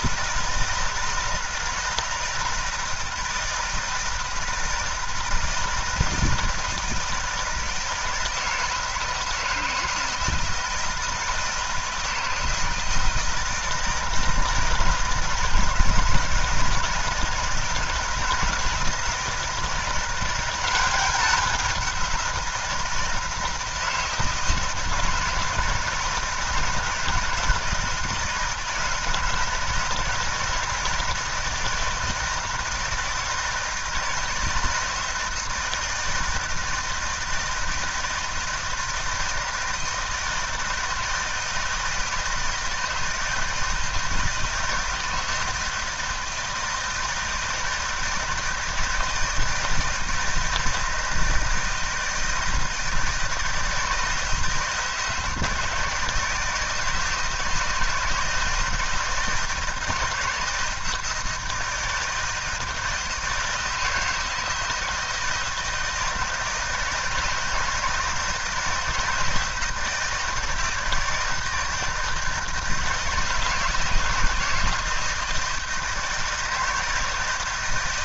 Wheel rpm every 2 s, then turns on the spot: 160, 160, 160, 160, 160, 160, 160, 160, 160, 170, 190, 170, 160, 170, 160, 160, 160, 160, 170, 160, 160, 160, 160, 160, 160, 160, 160, 160, 160, 160, 160, 160, 160, 160, 160, 160, 160, 160, 160.
none